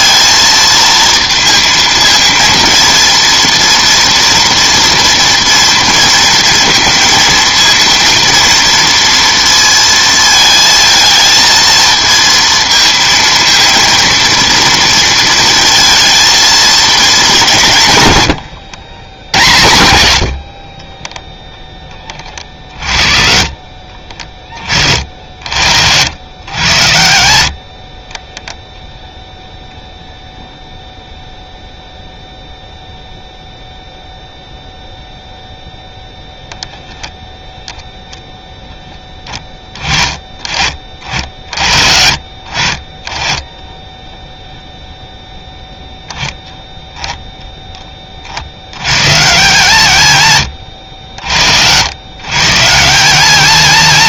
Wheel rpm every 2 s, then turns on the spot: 230, 230, 230, 230, 230, 220, 230, 230, 220, 110, 60, 50, 40, 100, 0, 0, 0, 0, 10, 10, 40, 40, 0, 10, 90, 100, 160.
18-24 42-44